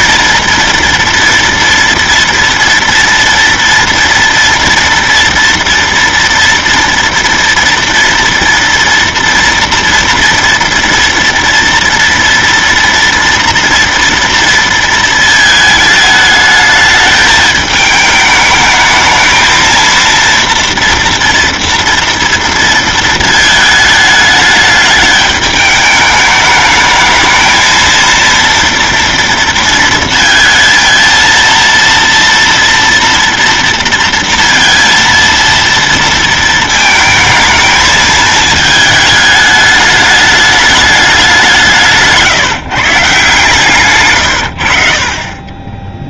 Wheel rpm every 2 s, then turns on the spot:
230, 230, 230, 230, 230, 230, 230, 230, 210, 220, 230, 230, 210, 210, 230, 230, 230, 230, 220, 220, 210, 150, 90.
none